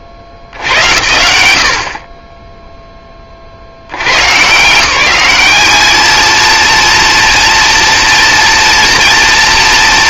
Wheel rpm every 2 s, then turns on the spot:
80, 0, 160, 230, 230.
none